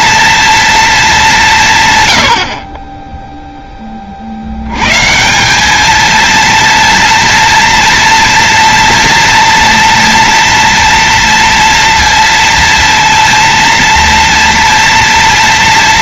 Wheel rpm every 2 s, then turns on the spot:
230, 110, 70, 230, 230, 230, 230, 230.
2-4